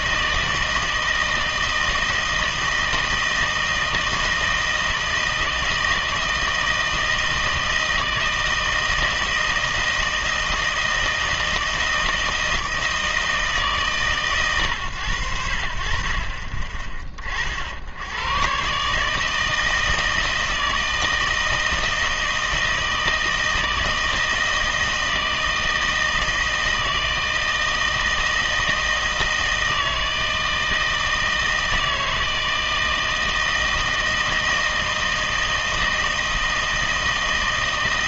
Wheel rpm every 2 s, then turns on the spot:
160, 160, 160, 160, 160, 160, 160, 120, 40, 140, 160, 160, 160, 160, 160, 160, 160, 160, 160.
none